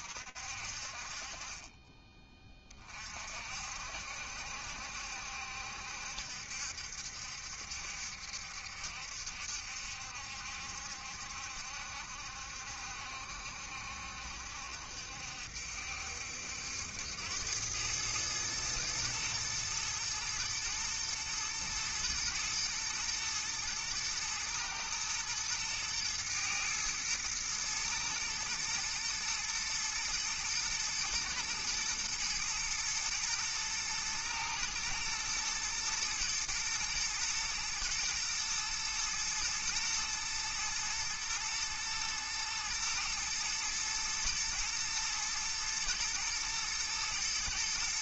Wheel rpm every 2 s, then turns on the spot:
30, 60, 70, 70, 70, 70, 70, 70, 100, 110, 120, 120, 110, 110, 110, 110, 110, 110, 110, 110, 110, 120, 120, 120.
none